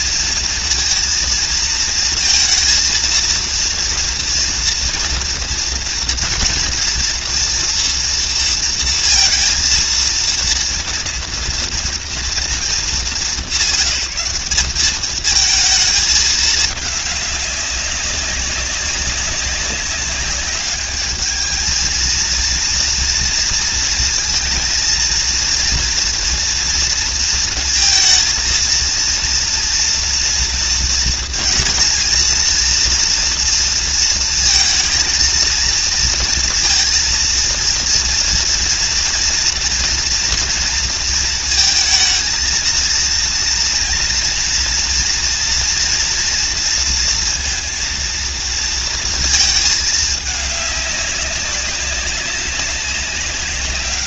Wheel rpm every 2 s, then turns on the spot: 230, 230, 230, 230, 230, 230, 230, 200, 210, 200, 200, 230, 230, 230, 230, 230, 220, 220, 230, 230, 230, 230, 230, 230, 230, 210, 200.
none